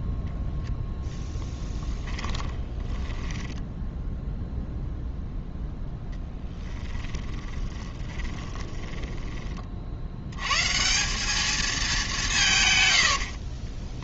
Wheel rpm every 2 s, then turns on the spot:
0, 10, 0, 10, 20, 110, 150.
2-4 6-10